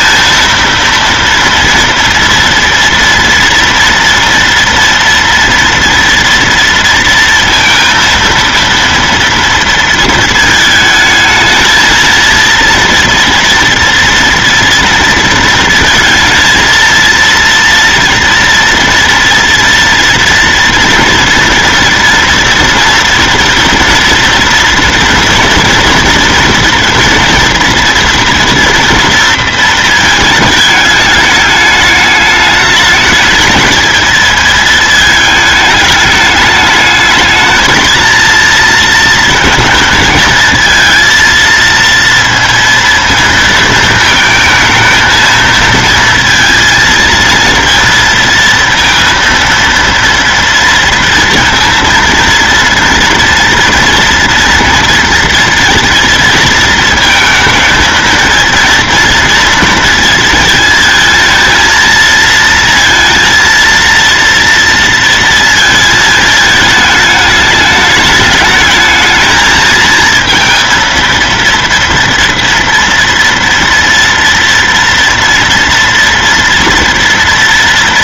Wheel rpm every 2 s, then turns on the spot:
230, 230, 230, 230, 230, 220, 230, 240, 230, 230, 230, 230, 230, 240, 240, 210, 210, 220, 210, 230, 230, 230, 220, 230, 230, 230, 230, 230, 220, 230, 230, 230, 230, 220, 210, 220, 230, 230, 230.
none